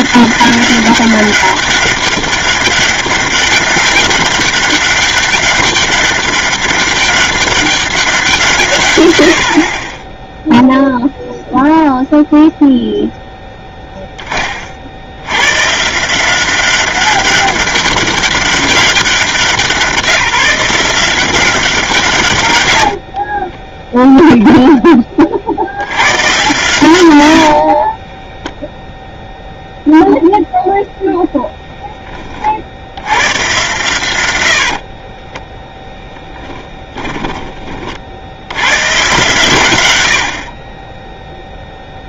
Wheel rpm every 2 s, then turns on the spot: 200, 200, 200, 200, 70, 0, 0, 80, 200, 200, 180, 60, 20, 110, 0, 0, 70, 50, 10, 110, 30.
22-24 34-38